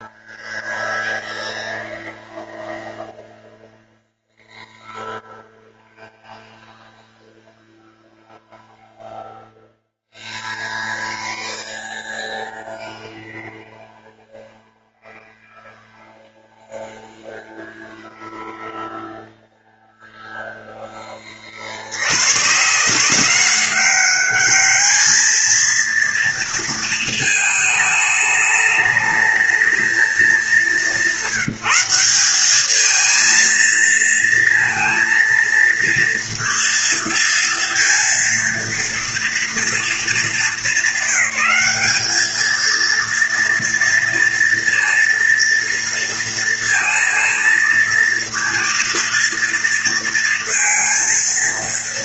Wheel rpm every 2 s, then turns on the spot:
0, 0, 0, 0, 0, 0, 0, 0, 0, 0, 20, 170, 220, 220, 220, 190, 220, 230, 230, 230, 210, 230, 230, 230, 230, 230.
none